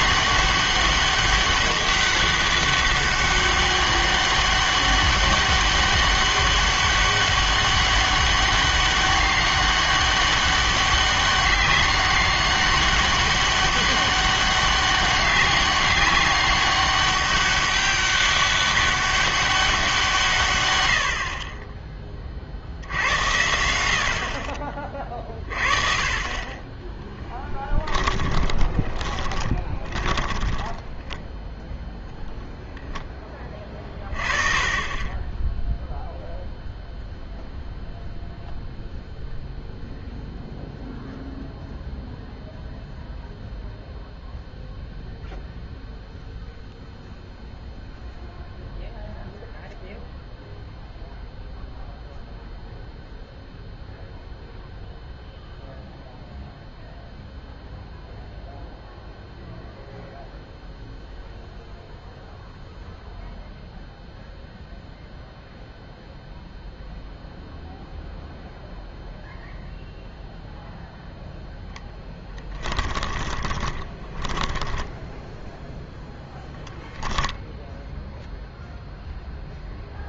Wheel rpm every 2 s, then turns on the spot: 200, 200, 200, 200, 200, 200, 200, 200, 200, 200, 130, 60, 30, 20, 20, 10, 0, 30, 0, 0, 0, 0, 0, 0, 0, 0, 0, 0, 0, 0, 0, 0, 0, 0, 0, 0, 10, 10, 10, 0.
28-32 72-76